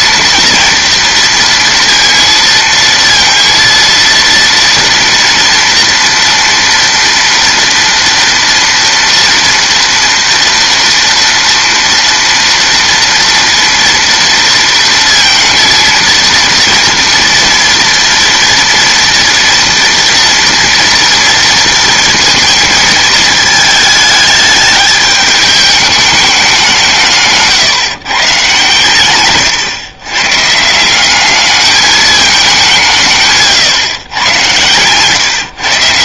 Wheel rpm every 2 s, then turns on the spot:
230, 230, 230, 230, 230, 230, 230, 230, 240, 230, 230, 230, 210, 190, 130, 160, 190, 110.
34-36